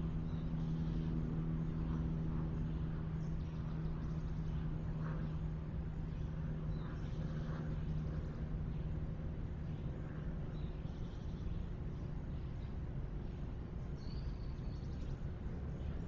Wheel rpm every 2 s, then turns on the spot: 0, 0, 0, 0, 0, 0, 0, 0.
none